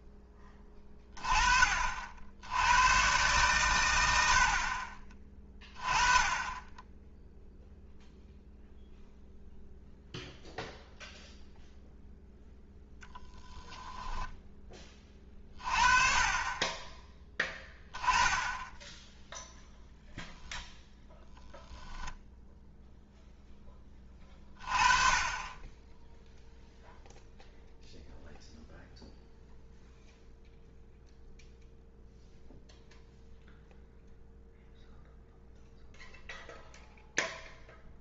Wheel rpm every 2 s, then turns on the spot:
10, 90, 60, 20, 0, 0, 0, 20, 20, 20, 0, 0, 30, 0, 0, 0, 0, 0, 0.
none